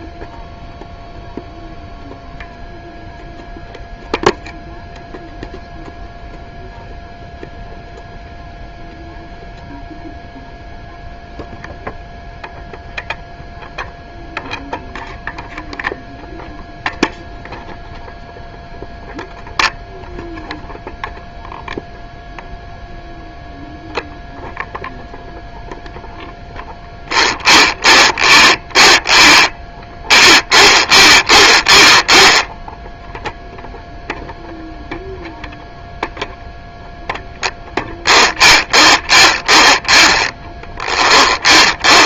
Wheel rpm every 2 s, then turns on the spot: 0, 0, 0, 0, 0, 0, 0, 0, 0, 0, 0, 0, 0, 0, 0, 0, 0, 0, 0, 0, 0.
none